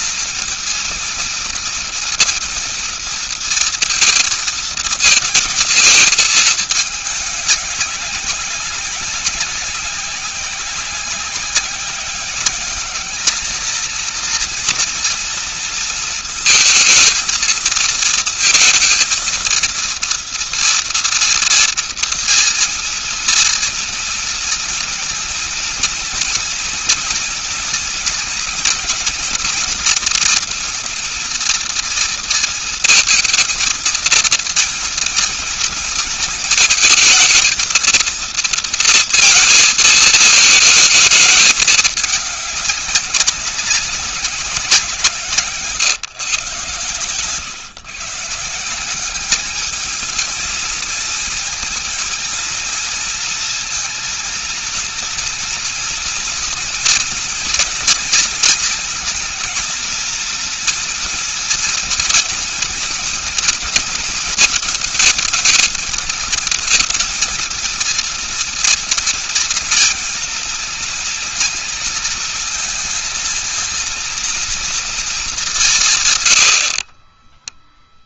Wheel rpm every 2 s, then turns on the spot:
230, 230, 230, 210, 190, 190, 210, 240, 220, 230, 230, 230, 230, 230, 240, 230, 230, 230, 220, 230, 220, 200, 170, 130, 190, 220, 230, 230, 230, 230, 230, 230, 220, 220, 230, 230, 230, 220, 30.
76-78